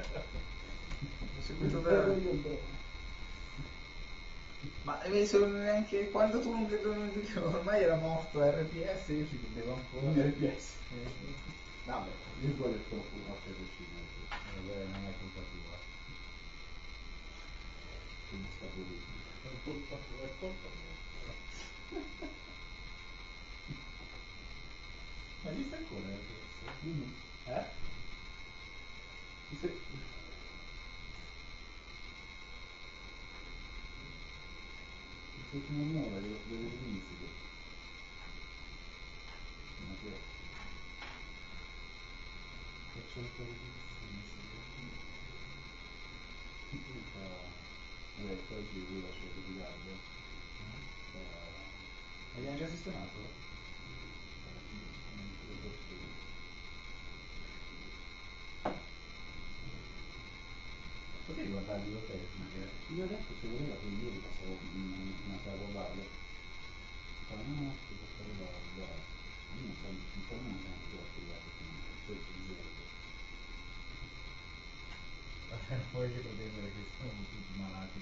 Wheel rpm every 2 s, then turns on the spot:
0, 0, 0, 0, 0, 0, 0, 0, 0, 0, 0, 0, 0, 0, 0, 0, 0, 0, 0, 0, 0, 0, 0, 0, 0, 0, 0, 0, 0, 0, 0, 0, 0, 0, 0, 0, 0, 0, 0.
none